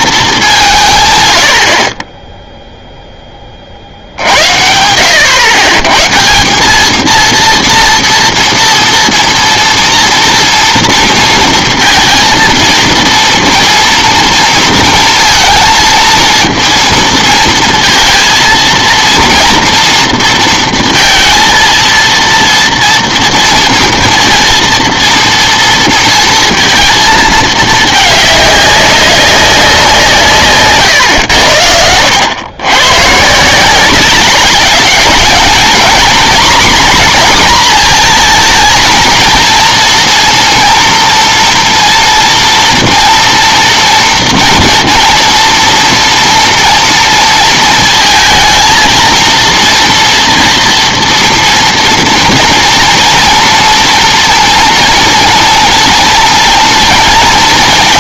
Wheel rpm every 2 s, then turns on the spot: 170, 0, 80, 190, 230, 230, 230, 230, 230, 230, 230, 230, 230, 230, 200, 140, 110, 210, 240, 230, 230, 230, 230, 230, 220, 230, 230, 240, 240.
none